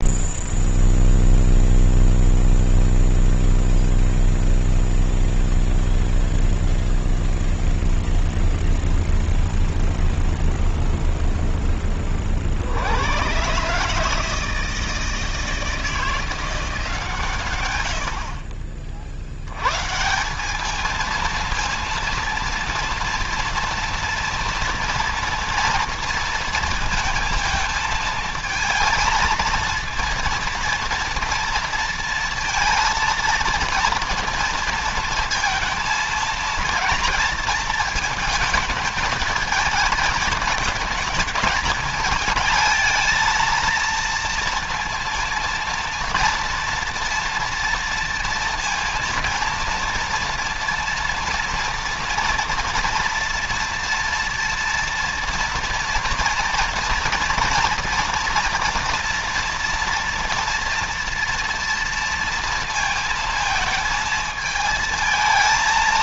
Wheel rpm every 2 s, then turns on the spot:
0, 0, 0, 0, 0, 0, 50, 160, 170, 50, 200, 230, 230, 230, 220, 240, 230, 230, 220, 220, 210, 220, 230, 230, 230, 240, 230, 230, 230, 240, 240, 230, 220.
none